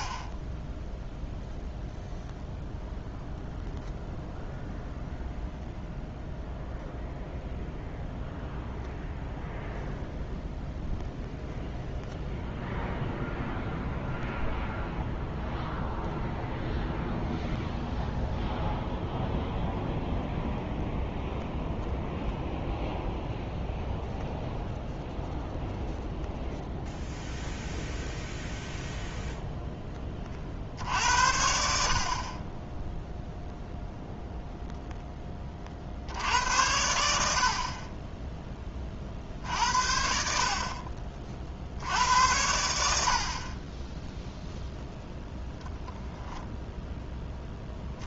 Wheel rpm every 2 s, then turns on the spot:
10, 0, 0, 0, 0, 0, 0, 0, 0, 0, 0, 0, 0, 0, 0, 60, 20, 0, 80, 20, 40, 80, 0, 0.
none